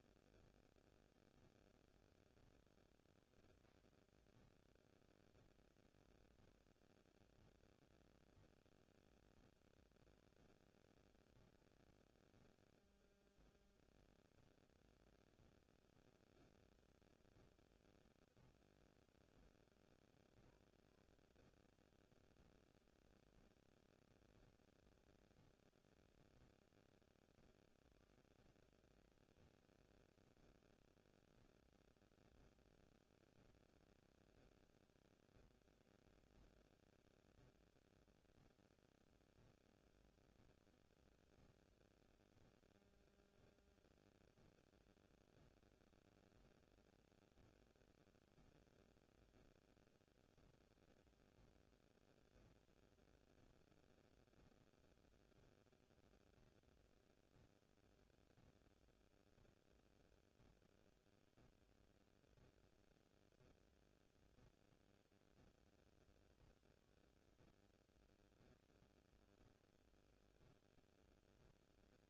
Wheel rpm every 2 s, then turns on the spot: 0, 0, 0, 0, 0, 0, 0, 0, 0, 0, 0, 0, 0, 0, 0, 0, 0, 0, 0, 0, 0, 0, 0, 0, 0, 0, 0, 0, 0, 0, 0, 0, 0, 0, 0, 0.
none